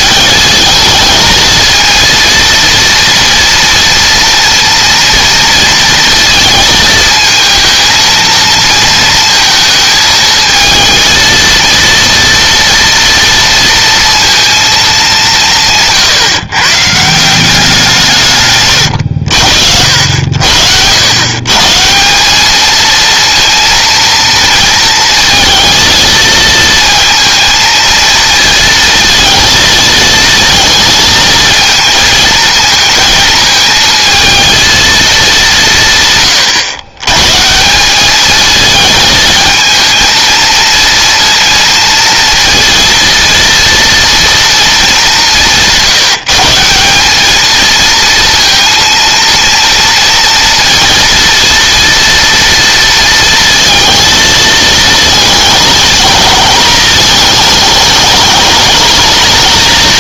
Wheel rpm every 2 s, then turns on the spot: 220, 230, 230, 220, 230, 230, 230, 220, 150, 100, 90, 230, 230, 230, 230, 220, 230, 220, 120, 220, 230, 230, 210, 190, 230, 230, 230, 220, 220, 220.
none